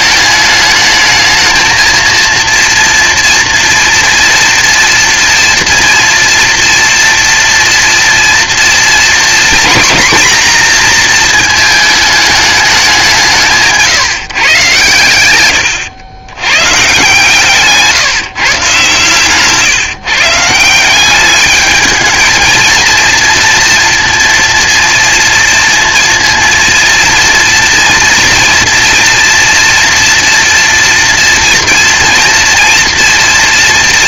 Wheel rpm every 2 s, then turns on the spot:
220, 230, 230, 230, 230, 240, 200, 130, 130, 130, 180, 230, 230, 230, 230, 230, 230.
none